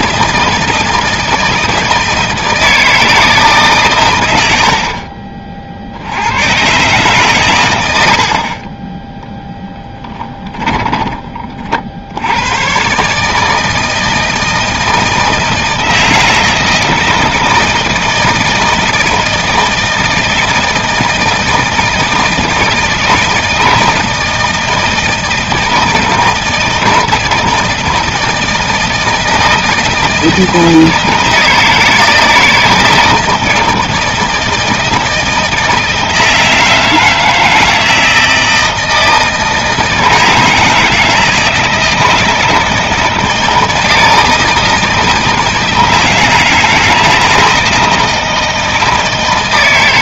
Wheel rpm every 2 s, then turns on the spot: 160, 160, 90, 110, 40, 10, 90, 160, 160, 160, 160, 160, 160, 160, 160, 160, 160, 160, 160, 160, 160, 160, 160, 160, 160.
10-12